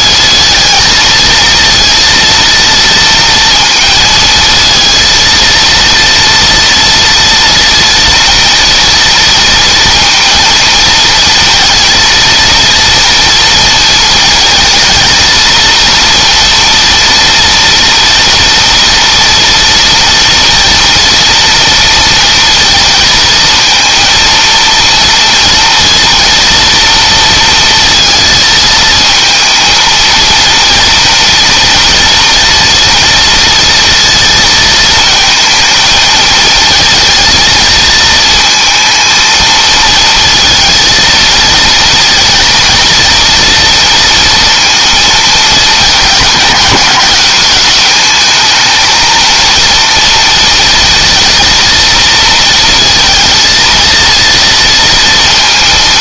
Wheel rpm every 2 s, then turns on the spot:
230, 230, 230, 230, 230, 220, 230, 230, 230, 230, 240, 230, 230, 230, 220, 230, 230, 220, 220, 230, 230, 230, 230, 180, 220, 230, 230, 230.
none